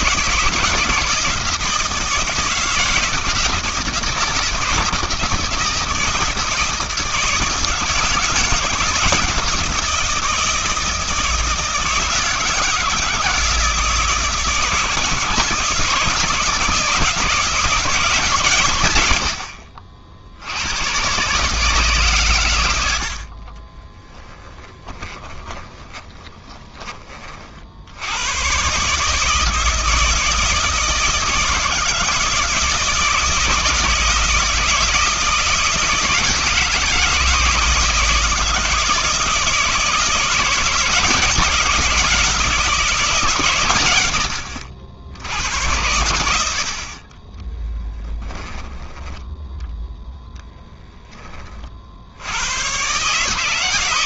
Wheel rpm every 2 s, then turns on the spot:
160, 160, 160, 160, 170, 160, 160, 160, 160, 140, 90, 90, 20, 20, 120, 160, 160, 160, 160, 160, 170, 170, 80, 60, 10, 0, 110.
24-28